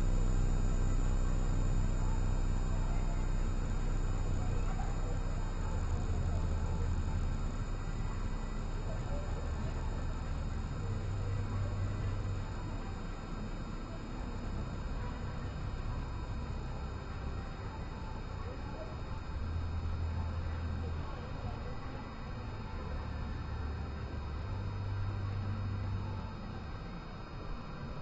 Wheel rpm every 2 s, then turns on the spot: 0, 0, 0, 0, 0, 0, 0, 0, 0, 0, 0, 0, 0, 0.
none